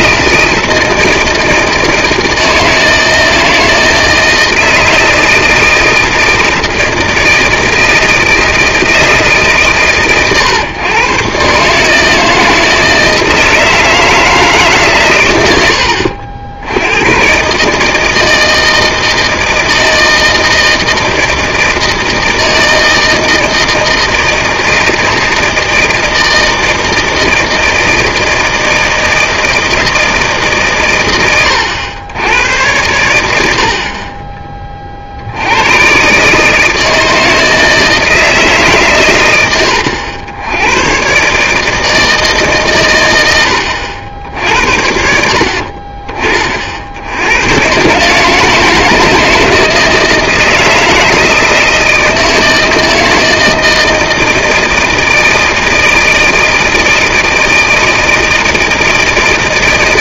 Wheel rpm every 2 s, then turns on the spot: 160, 160, 160, 160, 160, 120, 160, 150, 90, 160, 160, 160, 160, 160, 160, 140, 90, 30, 150, 140, 100, 140, 60, 60, 160, 160, 160, 170, 160, 160.
none